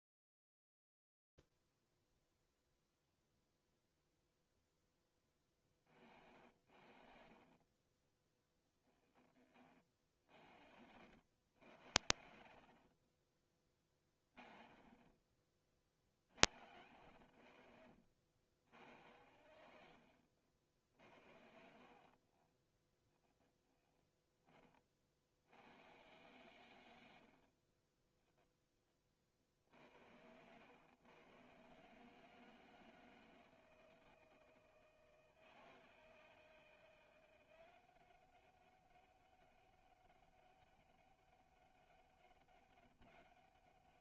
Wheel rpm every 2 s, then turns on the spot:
30, 0, 0, 50, 10, 40, 30, 20, 60, 80, 70, 20, 20, 120, 0, 100, 160, 160, 160, 190, 200, 200.
20-24